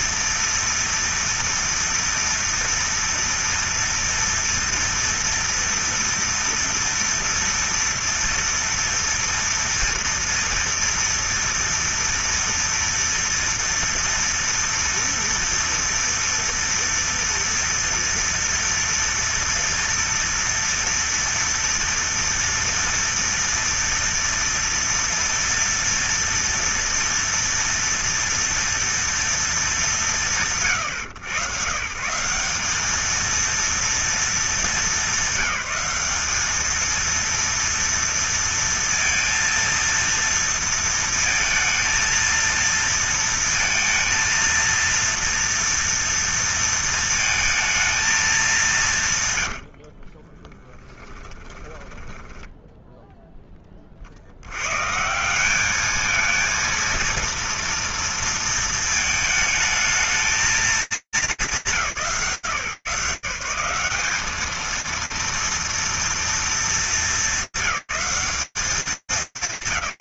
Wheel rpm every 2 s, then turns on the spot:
230, 230, 230, 230, 230, 230, 230, 240, 230, 230, 230, 230, 240, 230, 230, 120, 210, 200, 220, 230, 230, 230, 230, 230, 150, 20, 10, 120, 230, 230, 190, 90, 230, 210, 190.
50-54